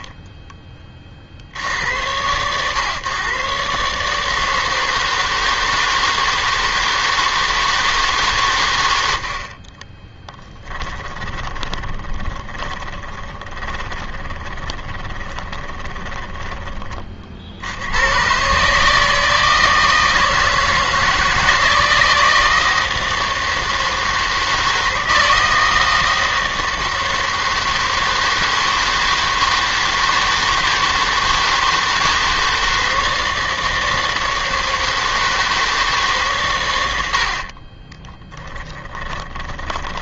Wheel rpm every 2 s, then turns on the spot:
20, 120, 160, 160, 110, 10, 20, 20, 30, 150, 160, 160, 160, 160, 160, 160, 160, 160, 100, 10.
10-16 38-40